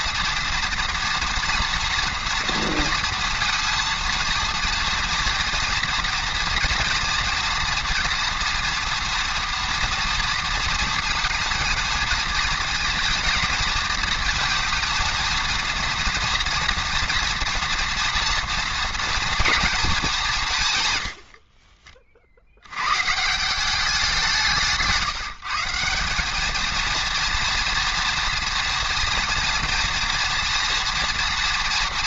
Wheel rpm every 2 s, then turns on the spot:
230, 230, 230, 230, 230, 230, 220, 230, 230, 230, 130, 100, 160, 220, 240, 230.
24-26